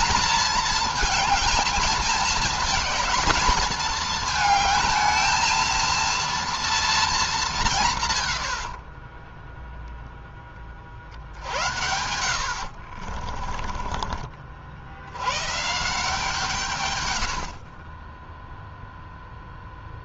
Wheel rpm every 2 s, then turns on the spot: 220, 220, 220, 230, 60, 40, 60, 60, 140, 0.
8-10 12-14